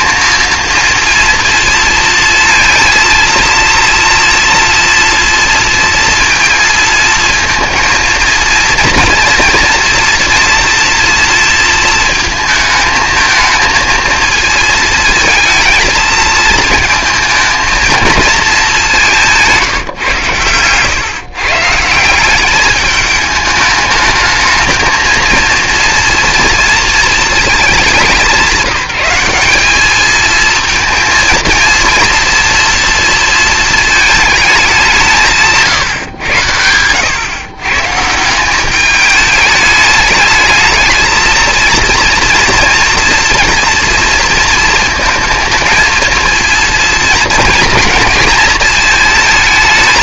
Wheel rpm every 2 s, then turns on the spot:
230, 230, 230, 230, 230, 230, 220, 220, 230, 210, 120, 210, 220, 230, 180, 230, 230, 210, 100, 190, 220, 230, 230, 230, 220.
none